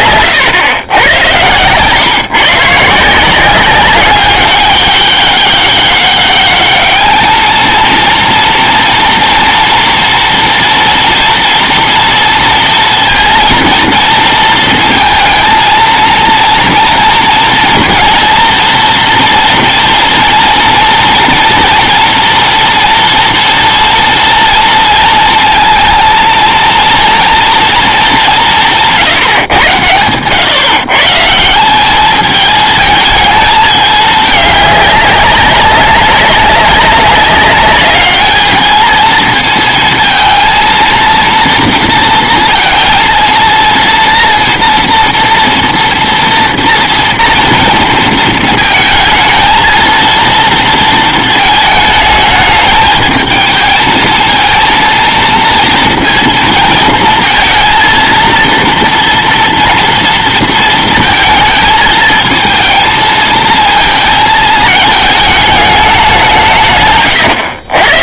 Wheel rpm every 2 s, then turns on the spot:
120, 140, 200, 210, 230, 230, 230, 230, 230, 230, 230, 230, 230, 230, 190, 130, 210, 210, 200, 220, 230, 230, 230, 230, 220, 230, 210, 230, 230, 230, 230, 220, 220, 160.
none